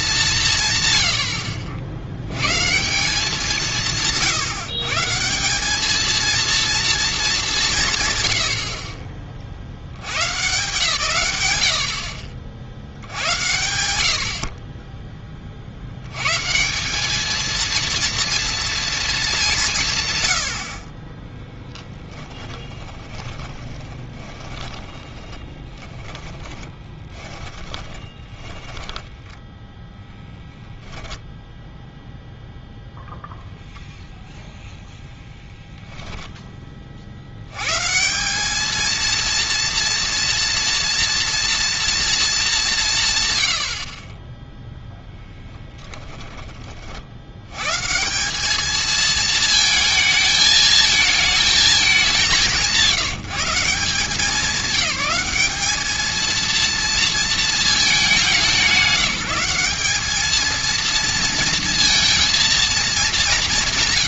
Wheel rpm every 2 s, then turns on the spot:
140, 160, 140, 230, 60, 140, 70, 30, 170, 230, 60, 20, 20, 20, 10, 10, 0, 0, 20, 210, 230, 200, 0, 30, 210, 220, 180, 190, 230, 190, 230, 230.
22-30